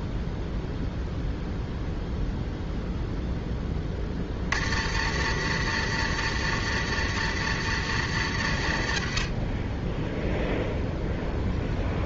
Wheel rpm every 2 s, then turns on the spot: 0, 0, 100, 120, 50, 0.
none